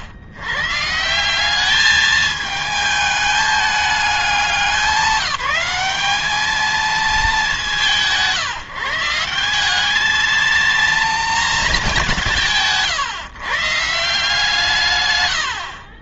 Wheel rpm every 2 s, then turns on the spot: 120, 220, 200, 210, 150, 220, 170, 140.
none